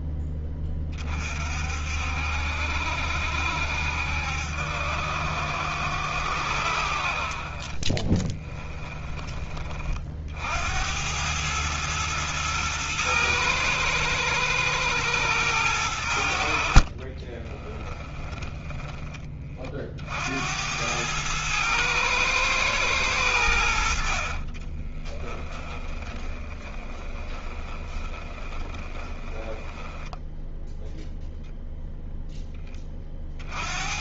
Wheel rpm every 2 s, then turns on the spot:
10, 60, 70, 60, 20, 60, 110, 100, 60, 20, 80, 110, 30, 30, 20, 10, 10.
8-10 16-20 24-30